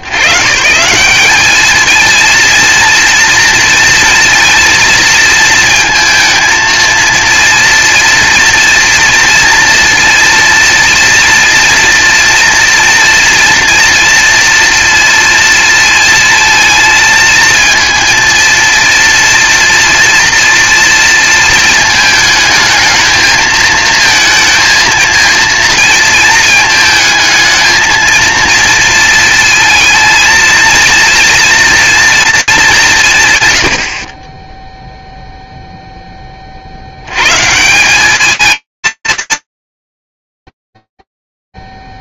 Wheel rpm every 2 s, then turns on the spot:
140, 230, 230, 220, 230, 230, 230, 230, 230, 230, 230, 220, 220, 220, 230, 230, 170, 0, 90, 210, 10.
none